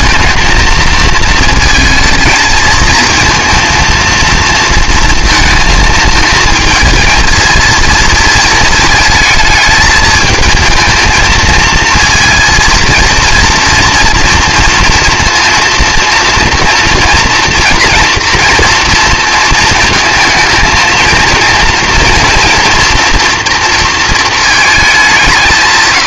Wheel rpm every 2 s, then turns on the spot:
220, 230, 230, 220, 220, 220, 230, 230, 230, 230, 230, 240, 220.
none